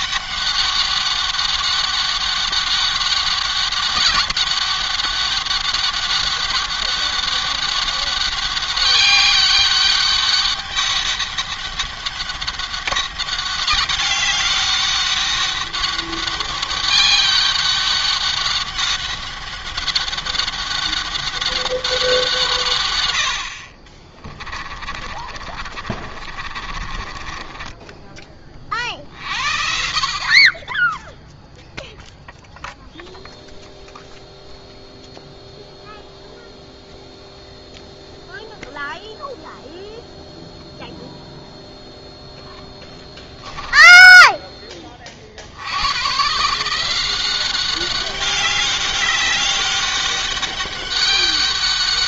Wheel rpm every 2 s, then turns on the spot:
200, 200, 200, 200, 200, 200, 200, 200, 200, 200, 200, 130, 30, 40, 40, 10, 0, 0, 0, 0, 0, 10, 20, 160, 200, 200.
24-28 42-44